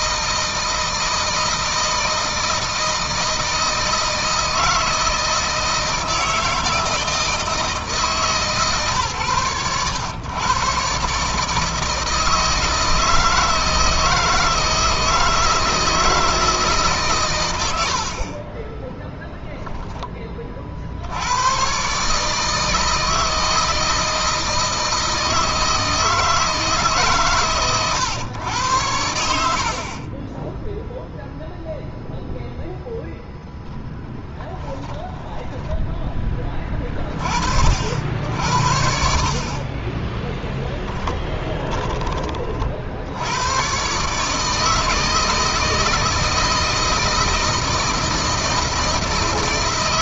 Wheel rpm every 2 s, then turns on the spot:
160, 160, 160, 160, 140, 120, 160, 160, 150, 20, 40, 150, 160, 160, 100, 10, 0, 10, 20, 60, 10, 40, 160, 160, 170.
18-20 34-36 40-42